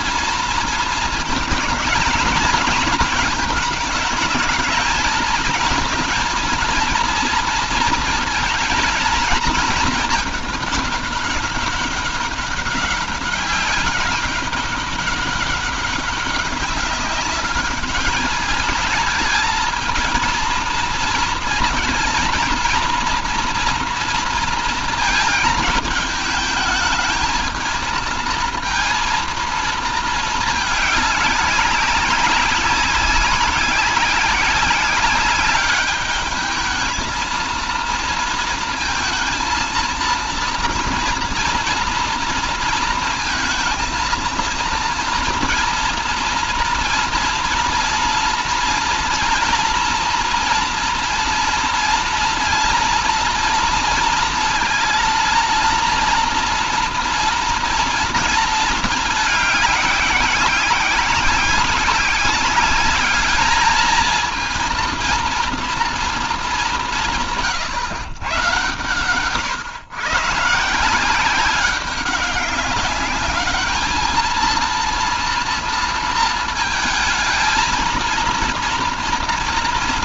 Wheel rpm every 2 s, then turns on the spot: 230, 220, 230, 230, 220, 200, 200, 200, 200, 210, 220, 230, 230, 220, 230, 210, 200, 190, 220, 230, 230, 230, 230, 230, 230, 230, 230, 230, 240, 220, 190, 200, 230, 180, 130, 170, 200, 230, 220, 230.
none